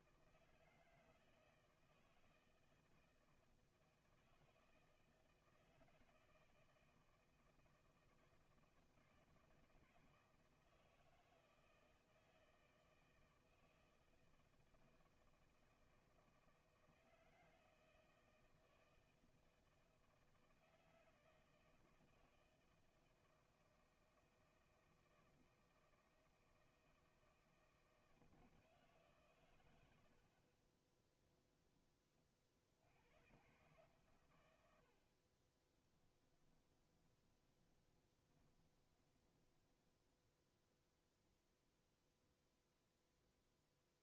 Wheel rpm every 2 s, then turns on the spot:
170, 160, 160, 160, 160, 160, 160, 160, 160, 160, 160, 160, 160, 160, 160, 30, 60, 80, 20, 20, 0, 0.
36-40